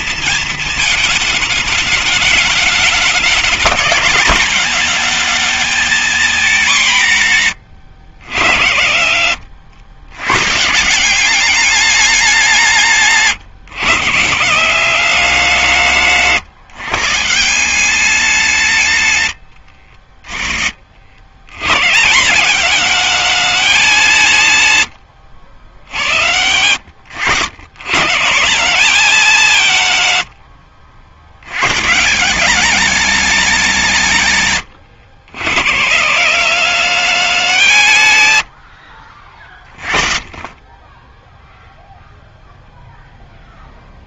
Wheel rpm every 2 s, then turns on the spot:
210, 200, 220, 120, 100, 200, 140, 160, 180, 60, 130, 180, 70, 110, 160, 110, 180, 110, 180, 40, 10, 0.
18-20